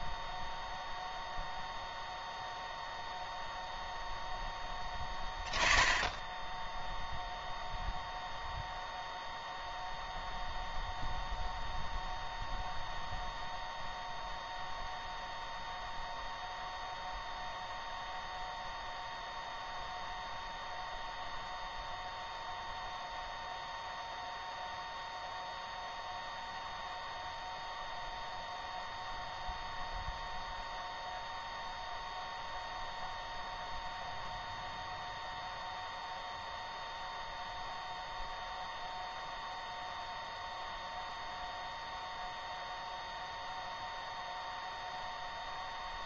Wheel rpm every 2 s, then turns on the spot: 0, 0, 10, 0, 0, 0, 0, 0, 0, 0, 0, 0, 0, 0, 0, 0, 0, 0, 0, 0, 0, 0, 0.
none